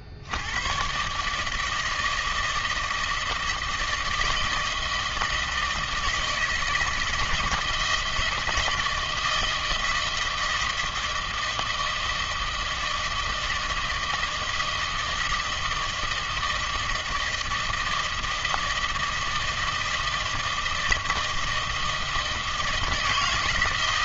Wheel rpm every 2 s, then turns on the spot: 60, 160, 160, 160, 160, 160, 160, 160, 160, 160, 160, 160.
none